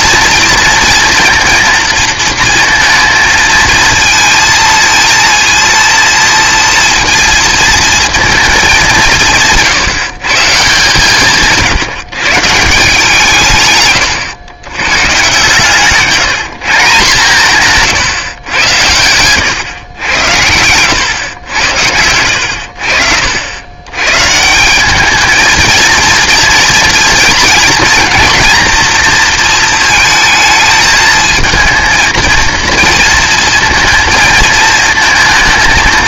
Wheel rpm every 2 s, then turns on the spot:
230, 230, 220, 230, 200, 160, 160, 110, 170, 100, 100, 80, 170, 230, 230, 220, 230, 220.
none